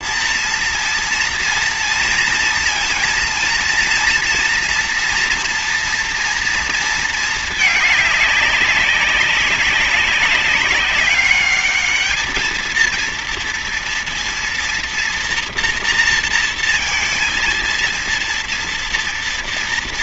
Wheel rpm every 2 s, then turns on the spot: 230, 230, 240, 220, 200, 200, 230, 230, 230, 230.
none